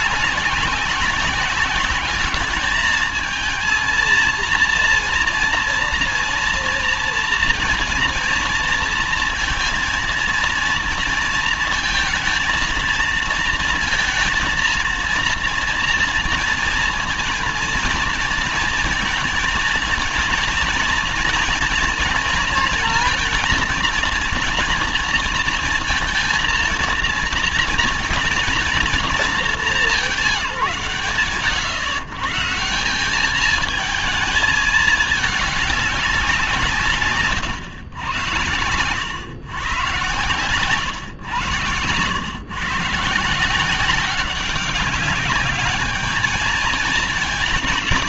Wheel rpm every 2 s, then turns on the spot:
190, 210, 230, 230, 230, 230, 230, 230, 230, 230, 230, 230, 230, 230, 230, 140, 170, 220, 160, 100, 120, 140, 200, 220.
none